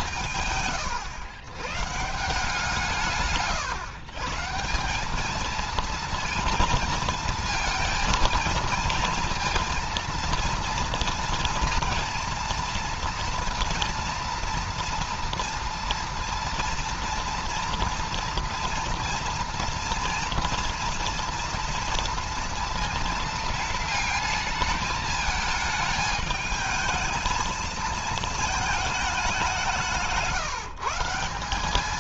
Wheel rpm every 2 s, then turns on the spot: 130, 120, 220, 230, 230, 230, 230, 230, 230, 230, 230, 230, 220, 220, 210, 180.
none